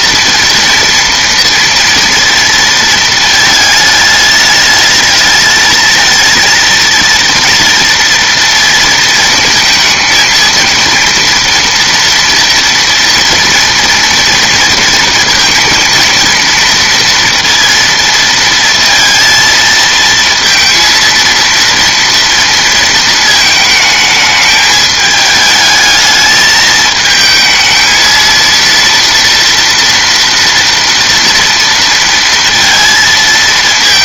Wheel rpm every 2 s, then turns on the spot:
230, 230, 210, 230, 230, 230, 230, 230, 230, 230, 230, 230, 210, 220, 230, 230, 230.
none